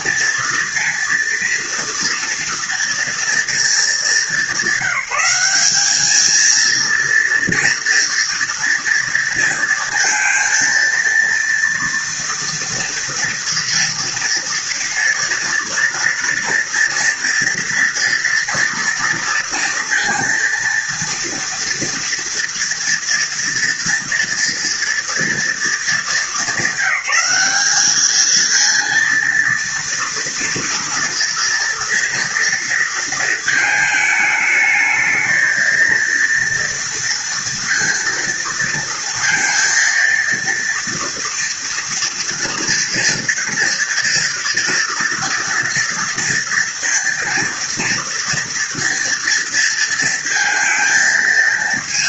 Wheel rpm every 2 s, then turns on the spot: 230, 230, 190, 230, 230, 230, 230, 230, 230, 230, 230, 230, 230, 210, 230, 230, 220, 220, 230, 230, 230, 230, 230, 230, 230, 230.
none